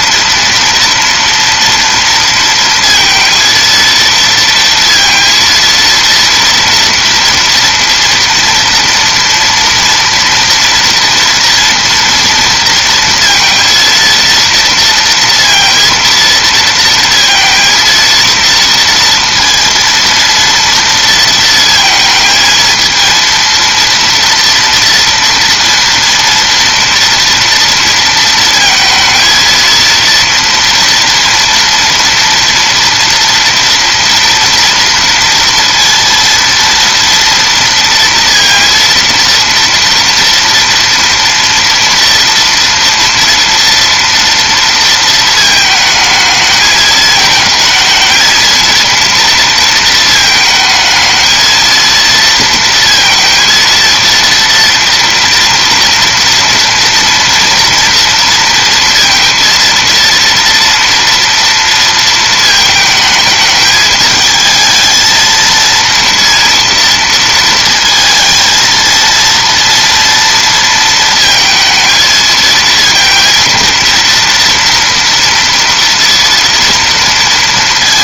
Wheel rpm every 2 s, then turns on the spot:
230, 230, 230, 230, 230, 230, 230, 230, 230, 230, 230, 220, 230, 230, 220, 230, 230, 230, 230, 230, 230, 230, 230, 210, 230, 220, 230, 230, 240, 230, 230, 220, 220, 230, 230, 230, 230, 230, 230.
none